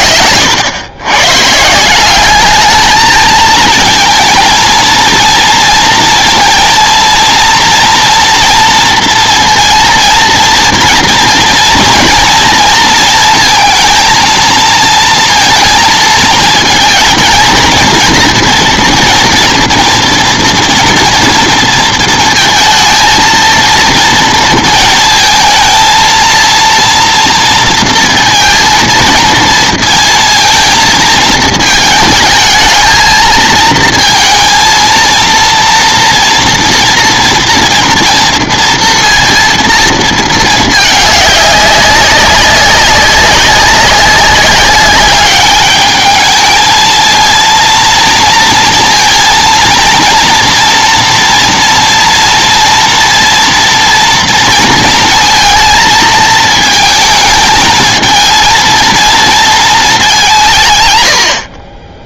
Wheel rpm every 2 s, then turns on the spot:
110, 220, 230, 230, 240, 230, 230, 230, 220, 230, 230, 230, 230, 230, 230, 220, 220, 230, 230, 230, 220, 190, 190, 220, 230, 230, 230, 230, 220, 230, 130.
none